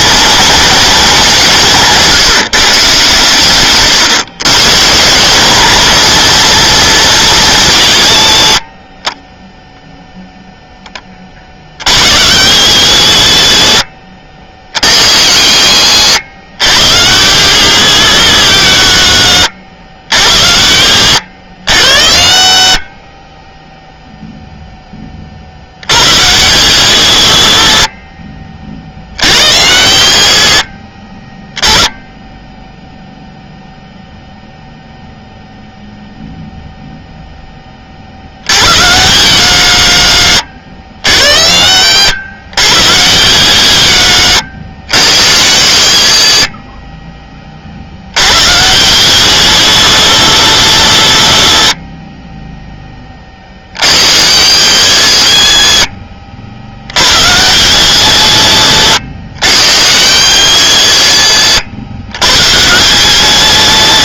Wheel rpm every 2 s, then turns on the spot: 220, 140, 140, 220, 60, 0, 90, 50, 70, 90, 50, 40, 0, 90, 40, 40, 0, 0, 0, 60, 50, 70, 90, 90, 70, 100, 10, 190, 50, 100, 190, 90.
14-16 52-54